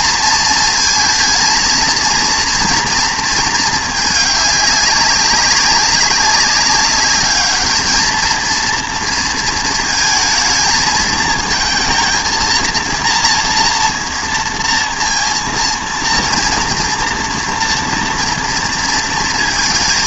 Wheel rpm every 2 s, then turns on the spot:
230, 230, 200, 200, 230, 220, 230, 230, 230, 230.
none